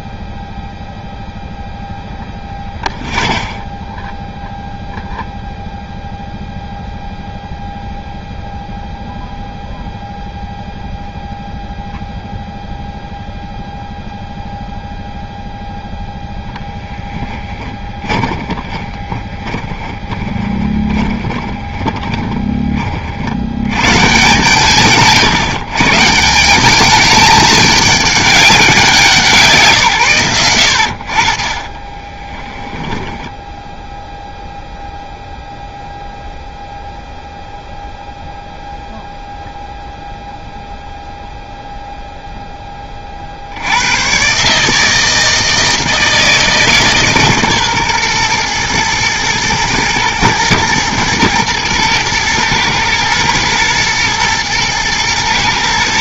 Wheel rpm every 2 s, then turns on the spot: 0, 0, 0, 0, 0, 0, 0, 0, 10, 30, 20, 20, 140, 190, 190, 90, 10, 0, 0, 0, 0, 10, 150, 150, 120, 110, 110, 120.
18-22